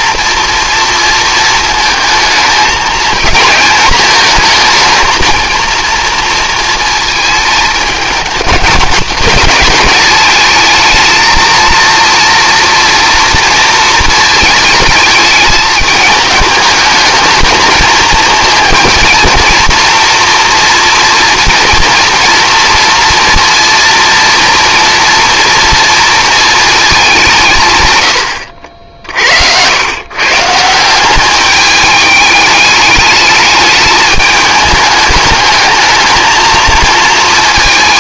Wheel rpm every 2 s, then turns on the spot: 240, 230, 220, 230, 210, 220, 230, 220, 210, 230, 230, 230, 230, 220, 80, 160, 210, 210, 220.
none